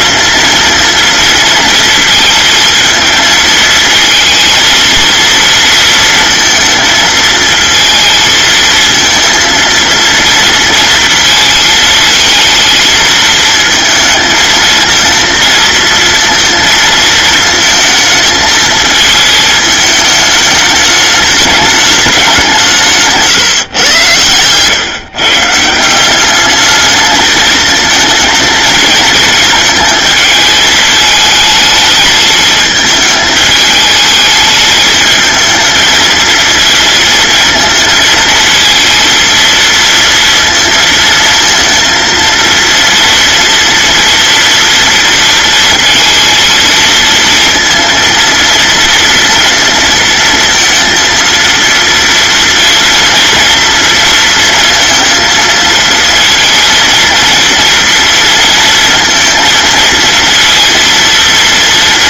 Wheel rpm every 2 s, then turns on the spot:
230, 220, 230, 230, 230, 230, 220, 220, 230, 220, 210, 170, 130, 210, 220, 220, 220, 220, 230, 230, 230, 230, 230, 230, 230, 230, 230, 230, 230, 230, 230.
none